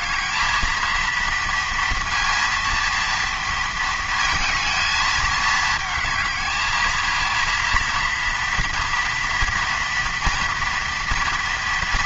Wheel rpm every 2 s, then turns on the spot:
230, 230, 230, 220, 230, 230.
none